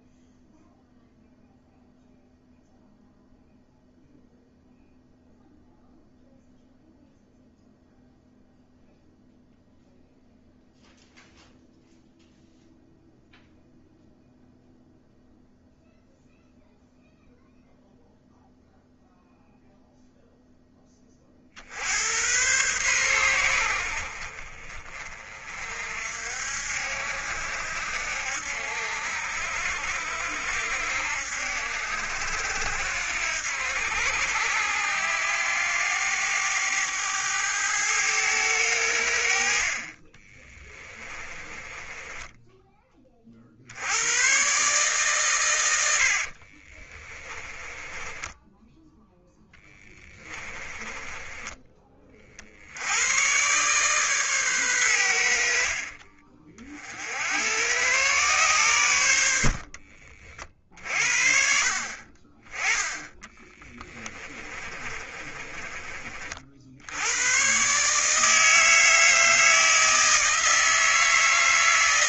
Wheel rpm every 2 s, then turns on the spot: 0, 0, 0, 0, 0, 0, 0, 0, 0, 0, 20, 110, 40, 60, 70, 70, 80, 90, 100, 90, 20, 20, 140, 20, 0, 20, 80, 100, 60, 90, 50, 10, 30, 80, 160, 160.
40-42 46-48 50-52 64-66